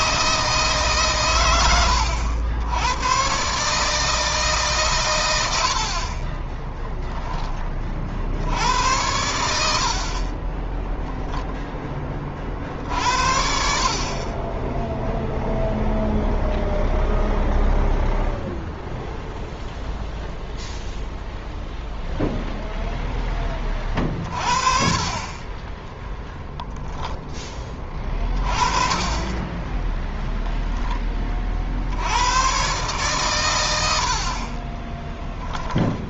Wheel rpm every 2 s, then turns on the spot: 140, 90, 140, 10, 80, 10, 50, 10, 0, 0, 0, 0, 40, 10, 20, 10, 120, 20.
6-8 10-12 34-36